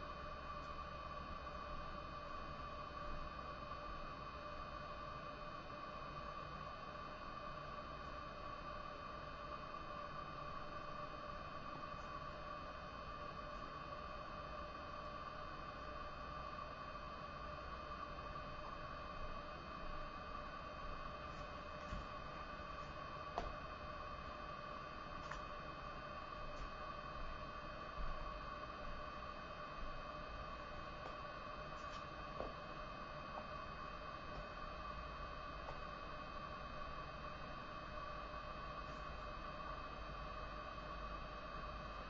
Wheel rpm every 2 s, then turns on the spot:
0, 0, 0, 0, 0, 0, 0, 0, 0, 0, 0, 0, 0, 0, 0, 0, 0, 0, 0, 0, 0.
none